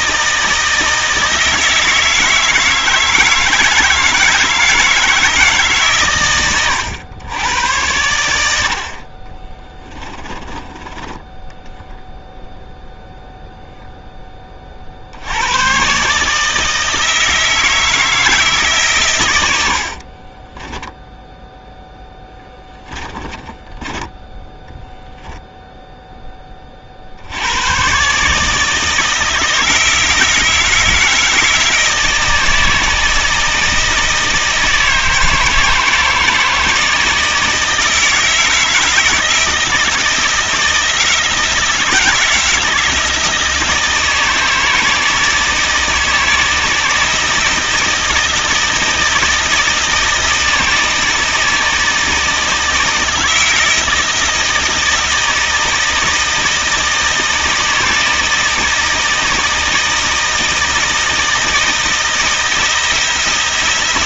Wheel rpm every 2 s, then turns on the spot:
160, 160, 160, 100, 50, 20, 0, 60, 160, 130, 10, 10, 0, 50, 160, 160, 160, 160, 160, 160, 160, 160, 160, 160, 160, 160, 160, 160, 160, 160, 160, 170.
10-12 20-24